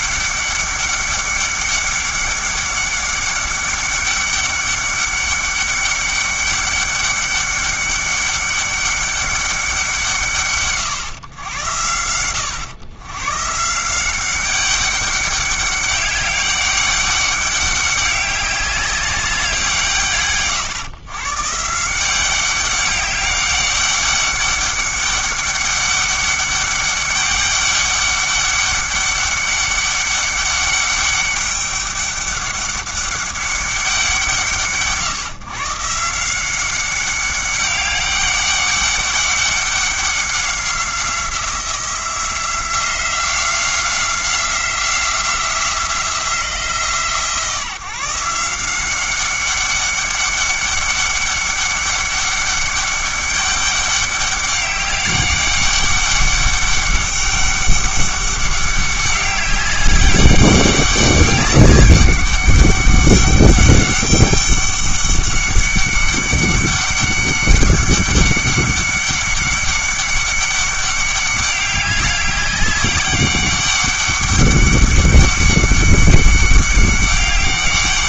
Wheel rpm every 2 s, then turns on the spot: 200, 200, 200, 200, 200, 120, 110, 200, 200, 200, 130, 190, 200, 200, 200, 200, 200, 160, 190, 200, 180, 180, 180, 160, 170, 200, 200, 200, 200, 200, 200, 200, 200, 200, 200, 200, 200, 200, 200.
none